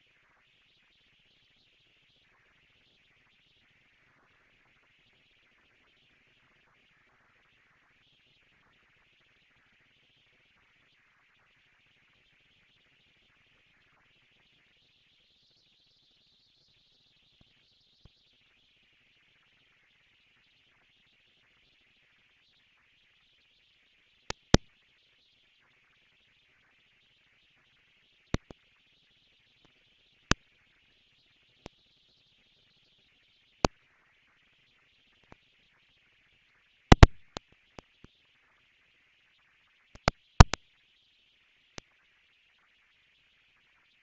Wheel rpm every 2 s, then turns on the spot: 230, 220, 160, 170, 220, 220, 230, 230, 230, 230, 230, 220, 230, 230, 210, 230, 240, 230, 230, 230, 230, 230.
none